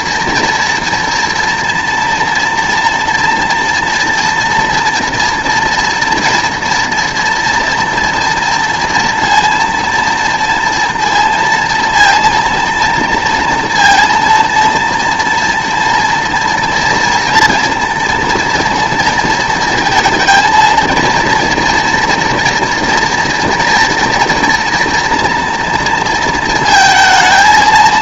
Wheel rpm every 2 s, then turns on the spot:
230, 240, 230, 230, 230, 230, 230, 230, 230, 230, 230, 230, 240, 220.
none